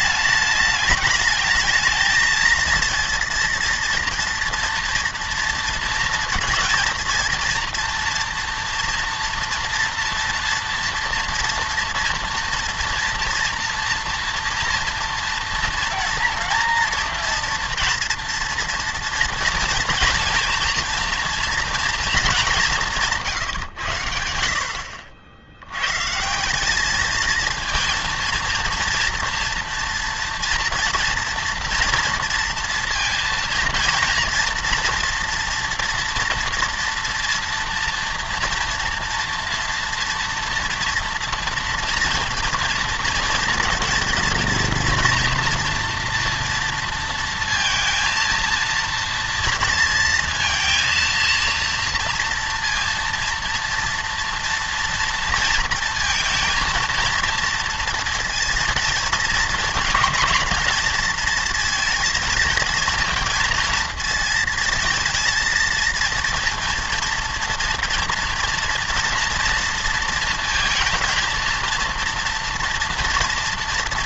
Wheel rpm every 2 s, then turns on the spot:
210, 230, 230, 220, 240, 240, 240, 230, 230, 230, 230, 200, 70, 200, 230, 230, 230, 230, 230, 230, 230, 230, 230, 230, 230, 230, 230, 230, 230, 230, 230, 230, 230, 230, 230, 220, 230.
none